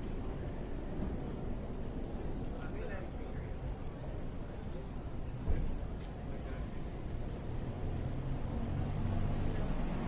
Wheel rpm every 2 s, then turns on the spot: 0, 0, 0, 0, 0.
none